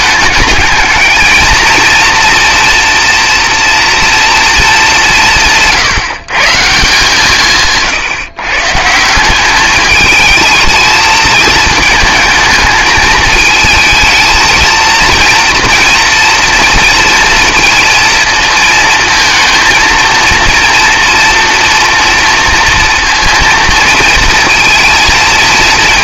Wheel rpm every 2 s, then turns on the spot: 210, 240, 220, 160, 150, 220, 220, 230, 230, 230, 230, 230, 230.
none